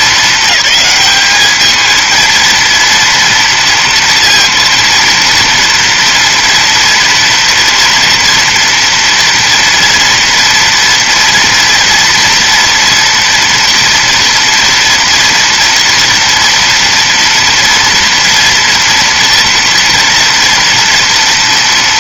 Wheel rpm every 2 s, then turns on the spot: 210, 230, 230, 230, 230, 230, 230, 230, 230, 230, 230.
none